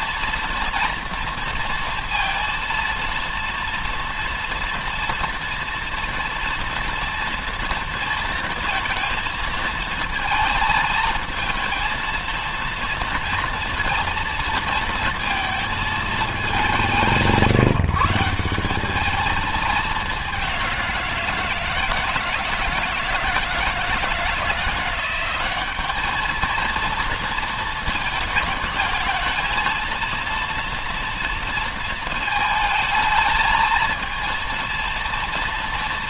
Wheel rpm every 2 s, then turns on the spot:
230, 230, 230, 230, 230, 220, 230, 230, 200, 180, 190, 160, 170, 220, 220, 230, 220, 230.
none